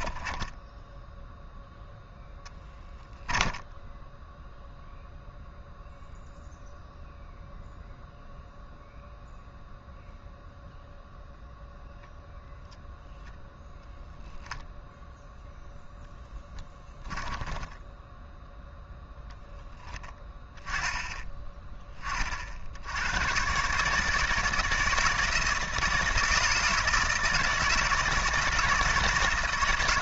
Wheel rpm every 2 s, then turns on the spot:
10, 10, 0, 0, 0, 0, 0, 0, 10, 0, 10, 70, 160, 160, 160.
0-2 16-18